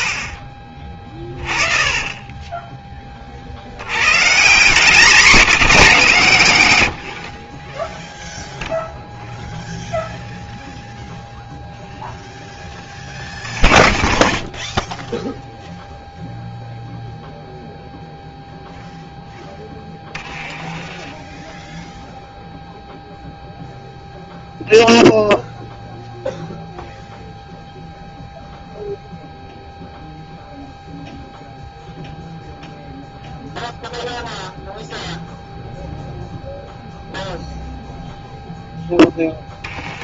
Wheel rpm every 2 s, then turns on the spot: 60, 20, 190, 110, 0, 0, 20, 0, 0, 10, 0, 0, 0, 0, 0, 0, 0, 0, 0, 20.
0-2 12-14 18-20